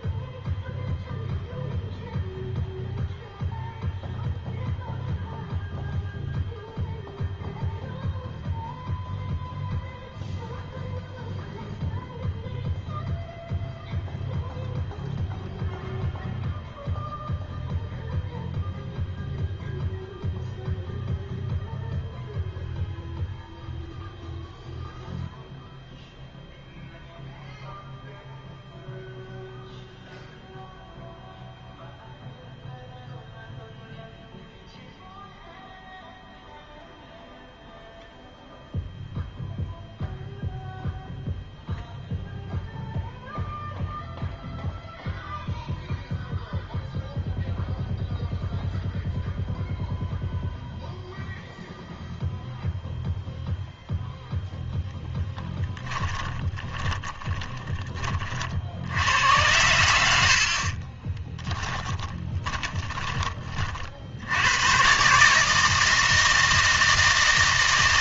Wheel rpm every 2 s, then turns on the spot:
0, 0, 0, 0, 0, 0, 0, 0, 0, 0, 0, 0, 0, 0, 0, 0, 0, 0, 0, 0, 0, 0, 0, 0, 0, 0, 0, 0, 20, 60, 40, 20, 110, 160.
56-58 60-64